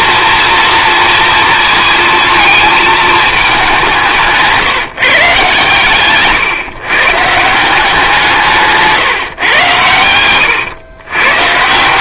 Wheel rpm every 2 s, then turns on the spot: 230, 220, 170, 120, 160, 110.
8-10